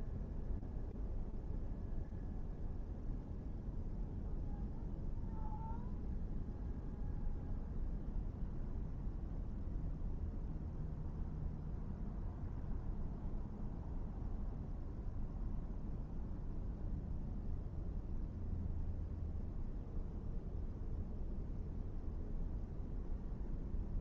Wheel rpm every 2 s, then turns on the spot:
0, 0, 0, 0, 0, 0, 0, 0, 0, 0, 0, 0.
none